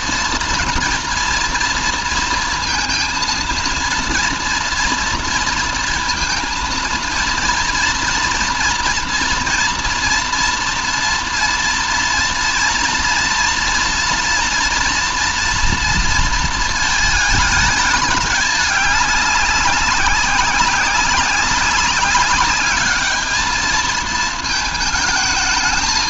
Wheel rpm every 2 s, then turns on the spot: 230, 230, 230, 230, 230, 230, 230, 240, 230, 200, 190, 210, 220.
none